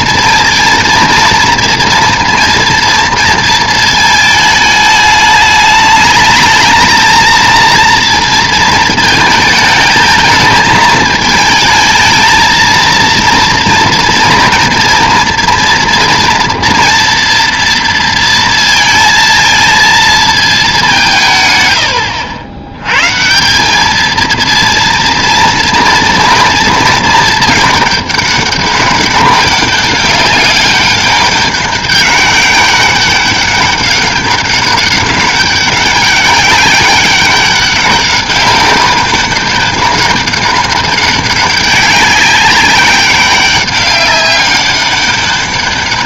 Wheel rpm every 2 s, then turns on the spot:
230, 230, 210, 220, 230, 220, 230, 230, 230, 230, 200, 100, 230, 230, 200, 200, 200, 200, 200, 200, 200, 200, 200.
none